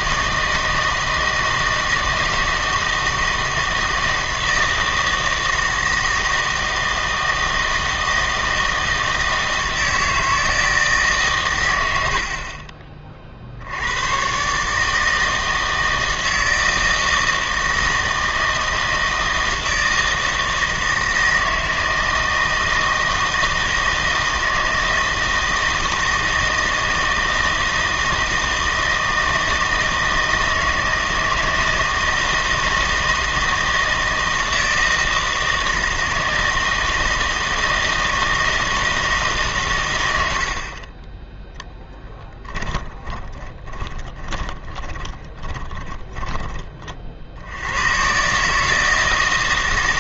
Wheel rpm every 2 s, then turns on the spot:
160, 160, 160, 160, 160, 160, 40, 140, 160, 160, 160, 160, 160, 160, 160, 160, 160, 160, 160, 160, 60, 10, 20, 30, 150.
42-46